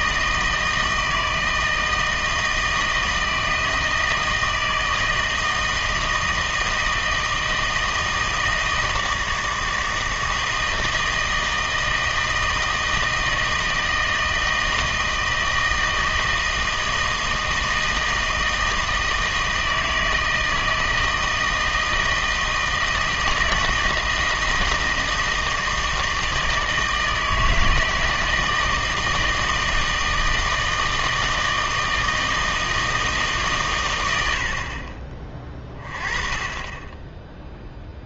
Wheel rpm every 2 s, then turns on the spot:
160, 160, 160, 160, 160, 160, 160, 160, 160, 160, 160, 160, 160, 160, 160, 160, 160, 50, 20.
none